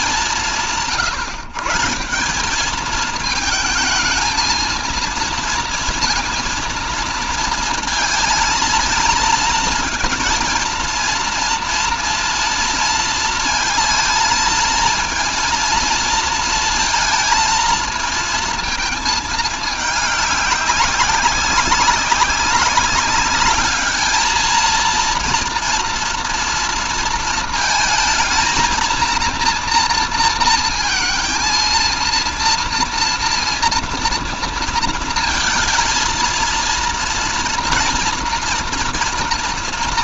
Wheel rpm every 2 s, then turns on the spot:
160, 200, 230, 230, 230, 230, 230, 230, 230, 220, 200, 200, 220, 230, 230, 230, 230, 230, 230, 230.
none